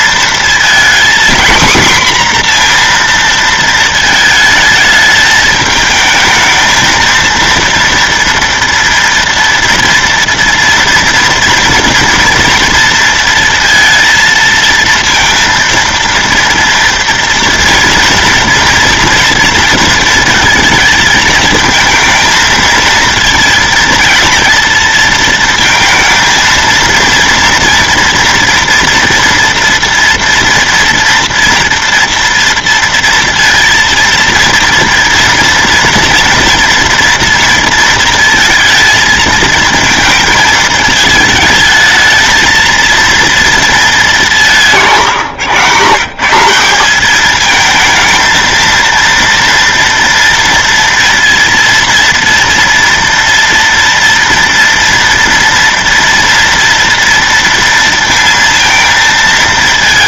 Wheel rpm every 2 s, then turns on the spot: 240, 240, 220, 220, 230, 230, 230, 230, 230, 240, 220, 230, 230, 230, 230, 230, 230, 230, 240, 230, 220, 230, 160, 190, 230, 230, 230, 230, 230, 230.
none